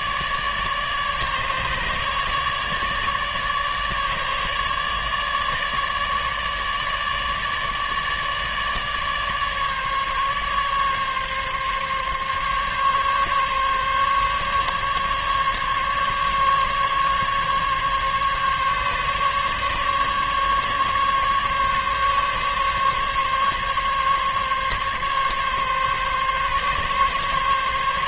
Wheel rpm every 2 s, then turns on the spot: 150, 150, 150, 150, 150, 140, 140, 140, 140, 140, 140, 140, 140, 140.
none